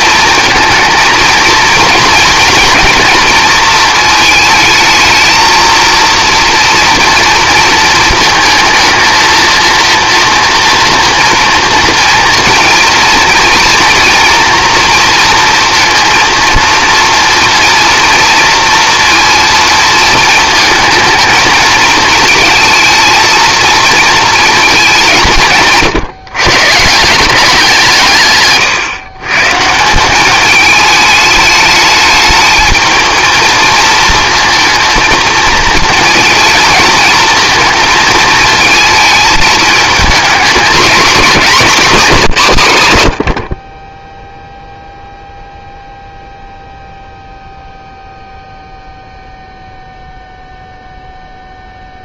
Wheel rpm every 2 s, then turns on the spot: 230, 240, 220, 230, 220, 230, 230, 230, 230, 230, 220, 220, 190, 160, 130, 210, 220, 230, 220, 220, 230, 110, 0, 0, 0, 0.
none